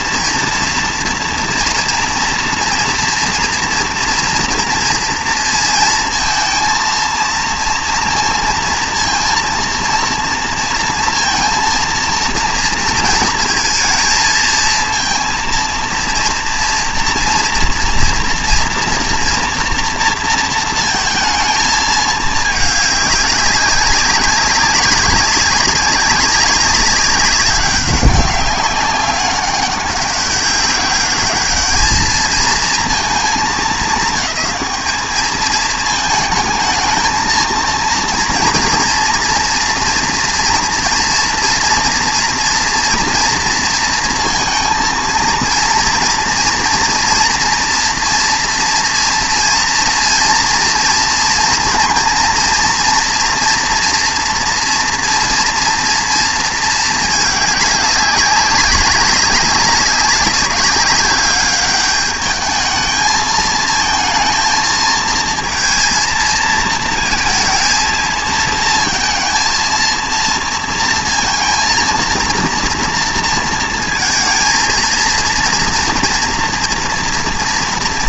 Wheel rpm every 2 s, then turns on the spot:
230, 230, 230, 230, 230, 230, 230, 220, 230, 230, 230, 210, 200, 190, 190, 200, 230, 210, 220, 230, 230, 230, 230, 230, 230, 230, 230, 230, 220, 190, 200, 210, 230, 230, 230, 230, 230, 230, 230.
none